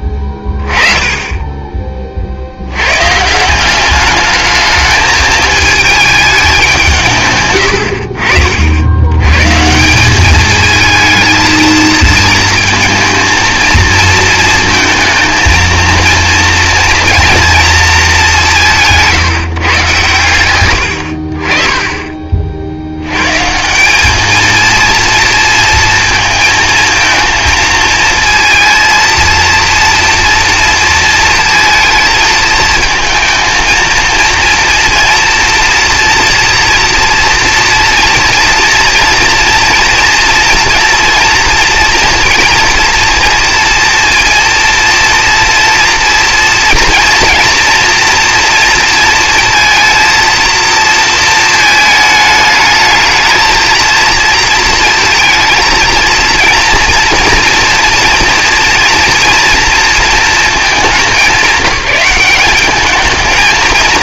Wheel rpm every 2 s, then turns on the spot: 20, 100, 220, 160, 70, 220, 230, 230, 230, 170, 100, 70, 230, 220, 230, 230, 220, 230, 230, 240, 230, 230, 230, 230, 230, 230, 220, 230, 230, 240, 200, 210.
none